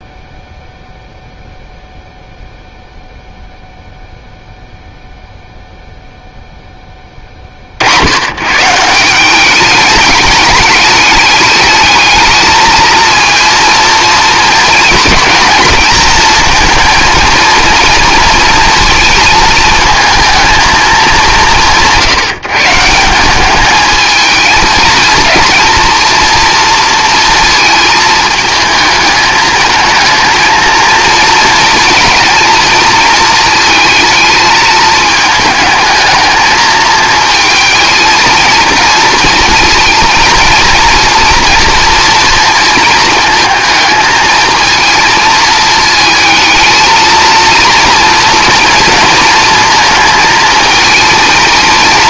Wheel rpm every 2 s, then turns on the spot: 0, 0, 0, 10, 140, 210, 220, 220, 220, 240, 220, 160, 220, 230, 220, 230, 230, 220, 220, 230, 230, 230, 220, 220, 230, 220.
none